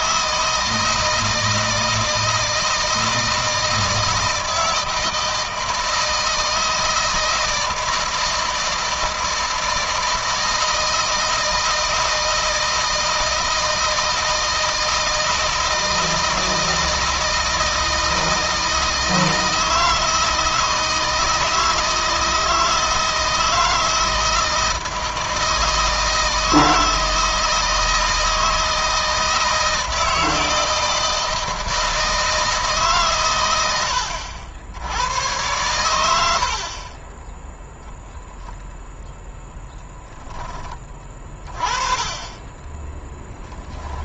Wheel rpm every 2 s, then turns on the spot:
160, 160, 160, 160, 160, 160, 160, 160, 160, 160, 160, 160, 160, 160, 160, 160, 140, 90, 30, 0, 20, 10.
42-44